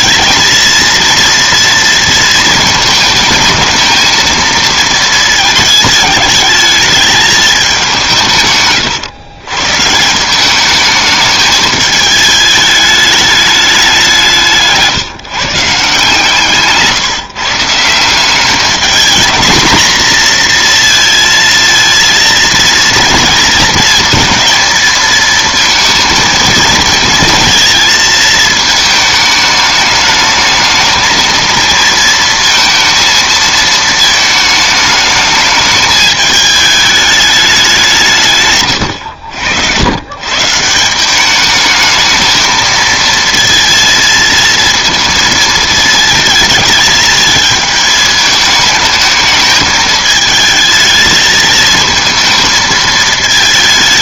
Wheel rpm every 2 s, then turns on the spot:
230, 220, 220, 210, 140, 200, 210, 170, 150, 200, 230, 230, 220, 230, 220, 220, 230, 220, 210, 130, 150, 220, 230, 220, 220, 220, 220.
14-16